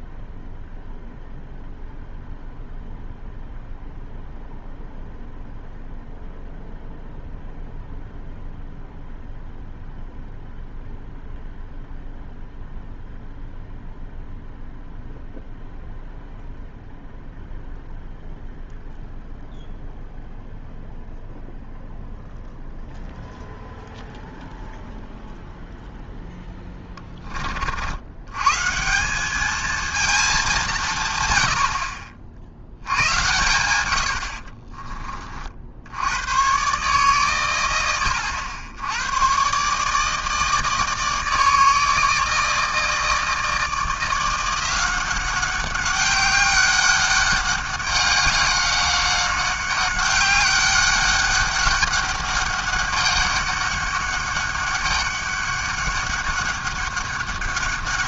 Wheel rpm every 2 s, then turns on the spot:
0, 0, 0, 0, 0, 0, 0, 0, 0, 0, 0, 0, 0, 10, 160, 170, 90, 40, 130, 100, 160, 160, 180, 200, 200, 200, 200, 200, 200.
34-36